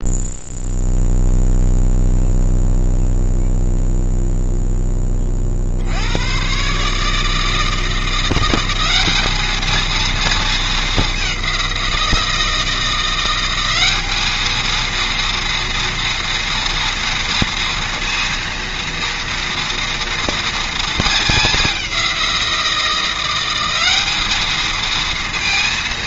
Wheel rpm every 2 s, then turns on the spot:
0, 0, 10, 140, 200, 210, 170, 230, 230, 230, 220, 170, 230.
none